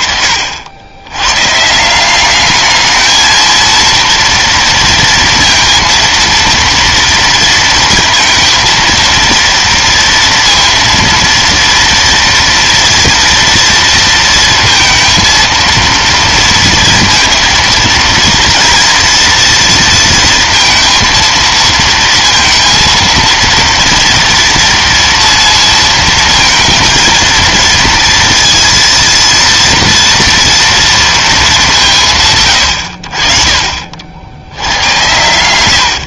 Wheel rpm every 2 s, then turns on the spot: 120, 190, 230, 230, 230, 230, 230, 230, 230, 230, 230, 230, 230, 230, 230, 230, 100, 50.
none